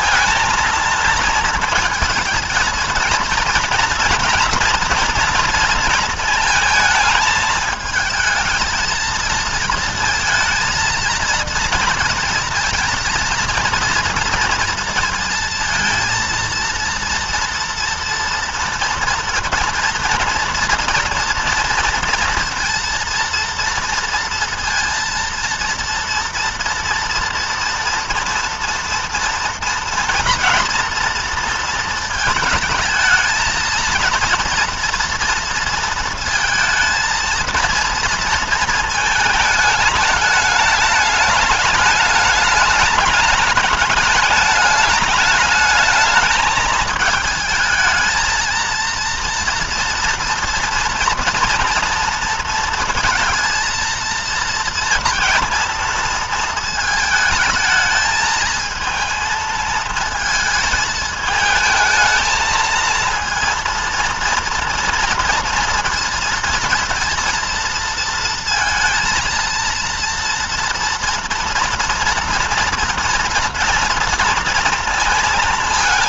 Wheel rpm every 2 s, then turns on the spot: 220, 230, 230, 220, 220, 220, 230, 230, 230, 230, 230, 230, 230, 230, 230, 230, 220, 230, 230, 230, 210, 210, 210, 220, 230, 230, 230, 230, 220, 220, 220, 230, 230, 230, 230, 230, 230, 230.
none